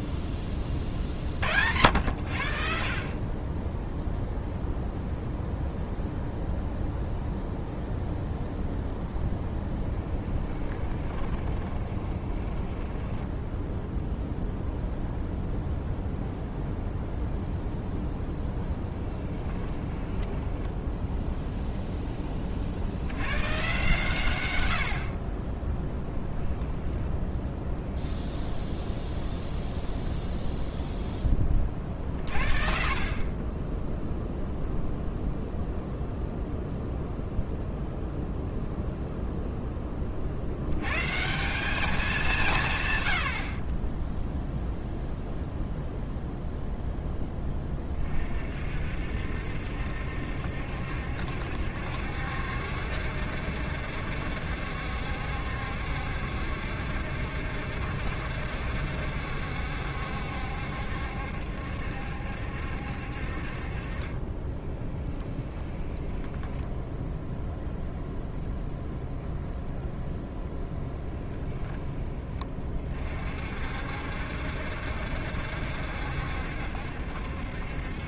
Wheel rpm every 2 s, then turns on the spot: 20, 60, 0, 0, 0, 20, 10, 0, 0, 10, 0, 60, 70, 0, 0, 0, 50, 0, 0, 0, 120, 130, 0, 0, 60, 70, 70, 70, 70, 70, 70, 60, 10, 0, 0, 0, 40, 70, 70.
10-14 64-66